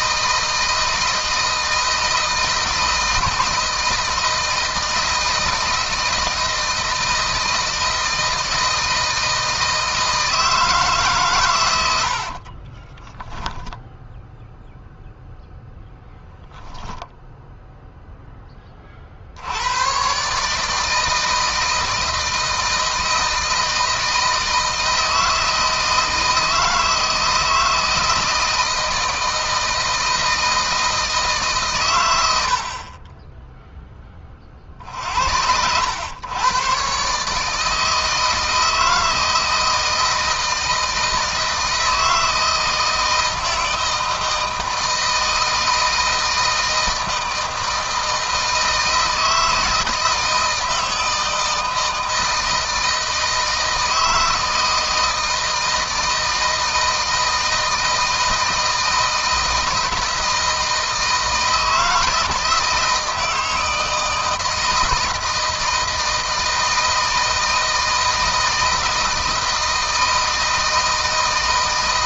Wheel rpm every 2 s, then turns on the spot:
160, 160, 160, 160, 160, 150, 20, 0, 10, 40, 160, 160, 160, 160, 170, 160, 40, 60, 130, 160, 160, 160, 160, 160, 160, 160, 160, 160, 160, 160, 160, 160, 160, 160, 160, 160.
12-14 16-18